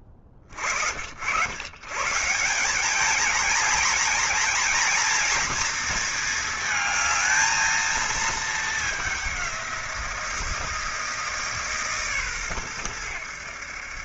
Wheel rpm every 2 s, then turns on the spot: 40, 210, 240, 230, 210, 160, 110.
none